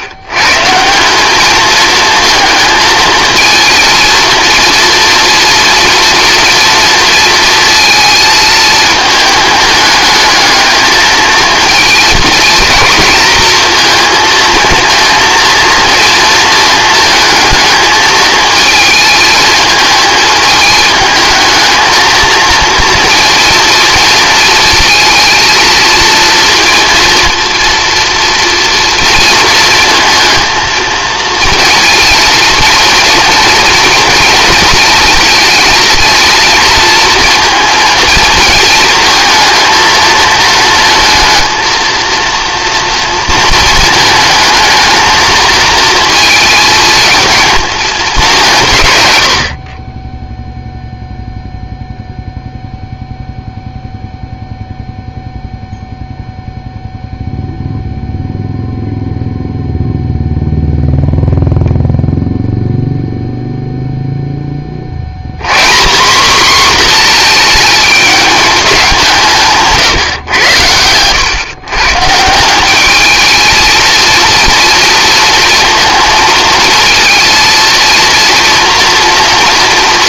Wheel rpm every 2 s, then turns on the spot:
150, 230, 230, 230, 220, 220, 230, 230, 220, 220, 210, 230, 220, 230, 230, 230, 230, 230, 230, 220, 230, 230, 220, 230, 160, 0, 0, 0, 0, 0, 0, 0, 30, 240, 200, 110, 190, 230, 230, 230.
none